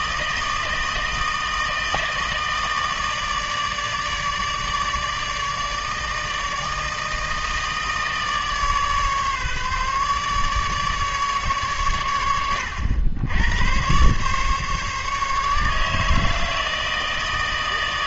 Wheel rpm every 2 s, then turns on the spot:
160, 160, 150, 160, 150, 150, 100, 140, 160.
none